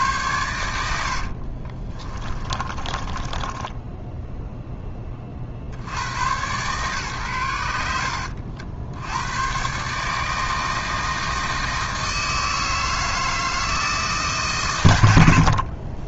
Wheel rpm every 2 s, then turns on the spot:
90, 20, 20, 130, 80, 160, 160, 100.
2-4